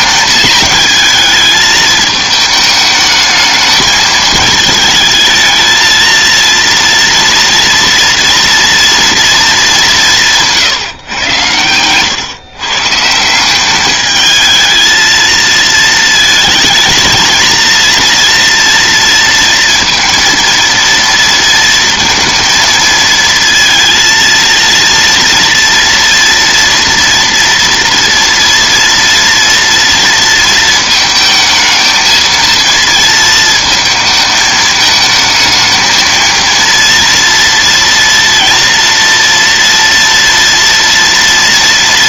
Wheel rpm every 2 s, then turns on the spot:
220, 220, 220, 230, 240, 130, 160, 220, 220, 230, 230, 220, 230, 230, 230, 220, 230, 220, 230, 240, 230.
none